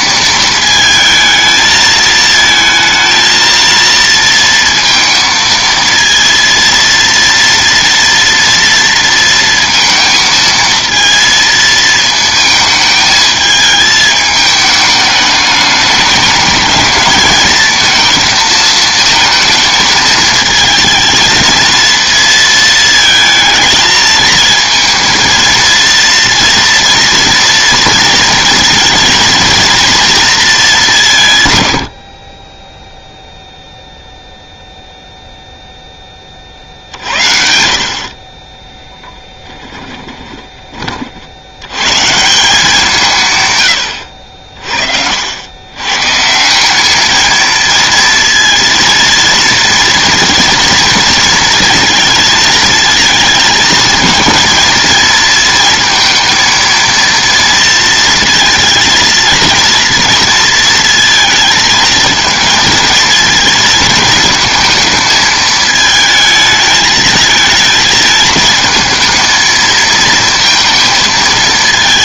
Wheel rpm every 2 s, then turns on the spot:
220, 220, 230, 230, 230, 230, 220, 210, 210, 220, 220, 230, 220, 240, 220, 200, 10, 0, 50, 10, 40, 170, 60, 200, 230, 230, 220, 220, 230, 230, 230, 230, 220, 220, 220, 230.
38-40